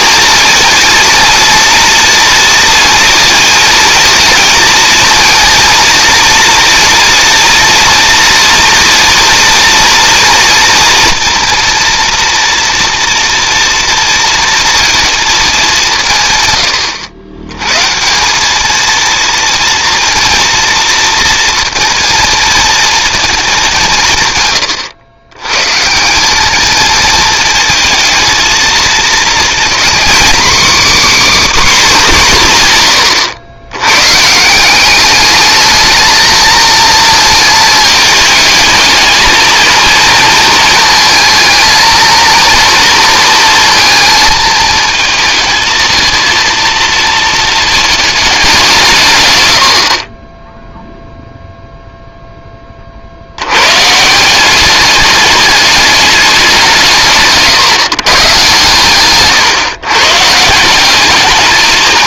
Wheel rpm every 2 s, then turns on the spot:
230, 230, 230, 230, 230, 230, 230, 230, 110, 220, 230, 230, 120, 220, 230, 280, 130, 170, 220, 220, 230, 230, 220, 230, 190, 0, 30, 200, 170, 120, 180.
none